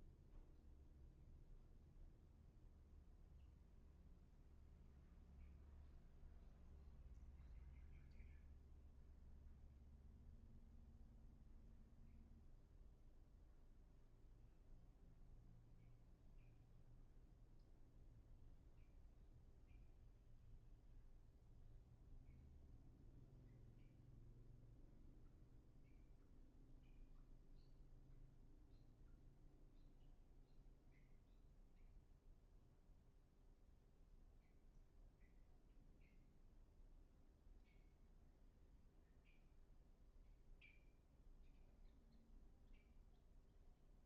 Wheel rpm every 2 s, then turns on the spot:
0, 0, 0, 0, 0, 0, 0, 0, 0, 0, 0, 0, 0, 0, 0, 0, 0, 0, 0, 0, 0, 0.
none